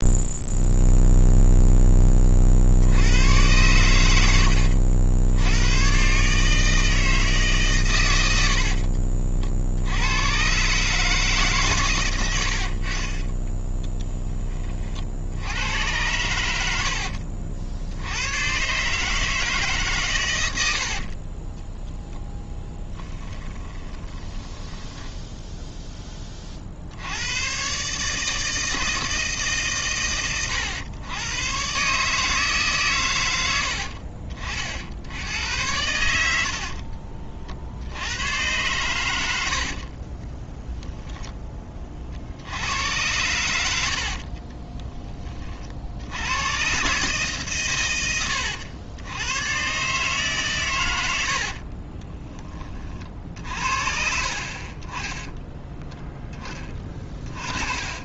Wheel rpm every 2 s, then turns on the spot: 0, 80, 80, 160, 50, 140, 40, 50, 70, 140, 60, 10, 10, 70, 160, 110, 130, 60, 40, 100, 10, 90, 20, 130, 90, 100, 40, 30, 30.
8-10 16-18 20-26 36-38 56-58